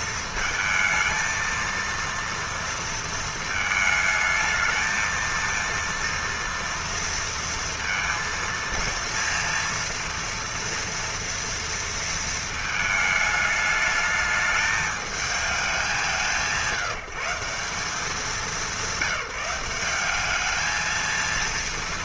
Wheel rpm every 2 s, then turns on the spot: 220, 230, 220, 230, 230, 230, 220, 210, 160, 200, 220.
none